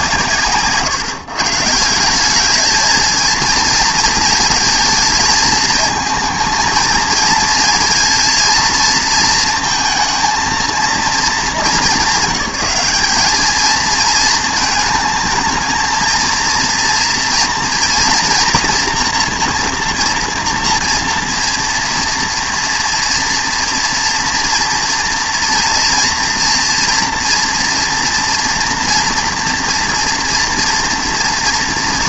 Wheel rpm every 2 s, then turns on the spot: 140, 210, 230, 220, 230, 230, 200, 220, 230, 240, 240, 230, 230, 230, 240, 230.
none